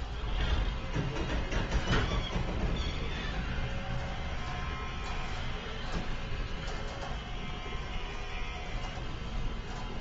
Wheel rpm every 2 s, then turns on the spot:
0, 0, 0, 0, 0.
none